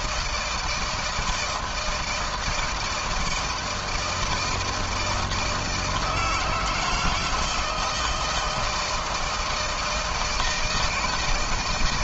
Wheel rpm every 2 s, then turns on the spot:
170, 160, 160, 160, 160, 160.
none